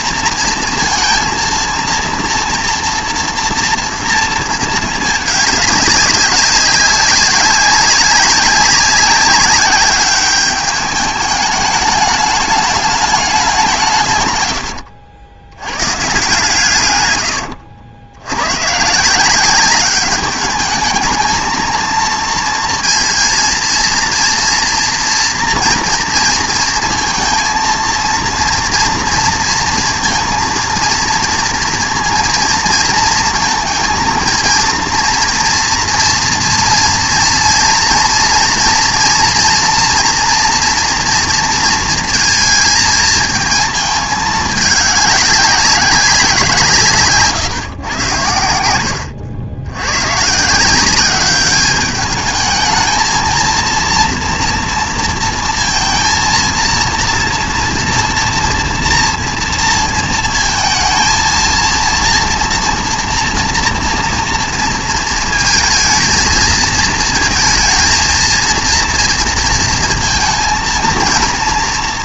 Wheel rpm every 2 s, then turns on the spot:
230, 230, 220, 200, 190, 210, 210, 100, 130, 130, 210, 230, 230, 230, 230, 230, 230, 230, 240, 230, 230, 230, 200, 160, 90, 180, 220, 230, 230, 230, 220, 230, 230, 230, 230, 230.
14-16